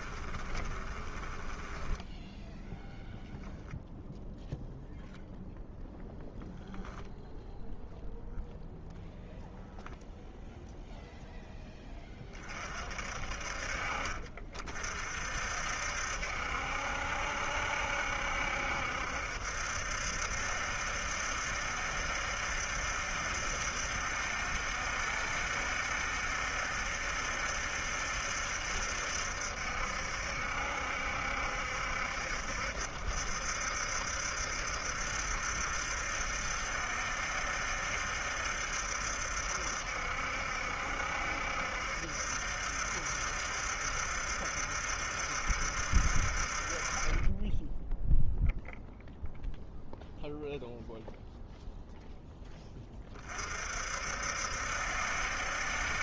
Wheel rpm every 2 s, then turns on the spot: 10, 0, 0, 0, 0, 0, 60, 50, 70, 70, 70, 70, 70, 70, 70, 70, 70, 70, 70, 70, 70, 70, 70, 30, 0, 0, 30, 70.
0-2